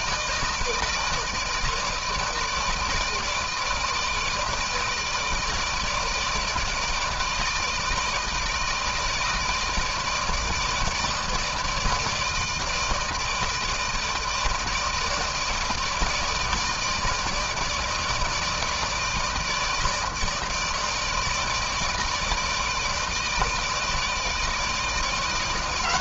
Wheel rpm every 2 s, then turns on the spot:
160, 160, 150, 160, 160, 160, 160, 160, 160, 160, 160, 160, 160.
none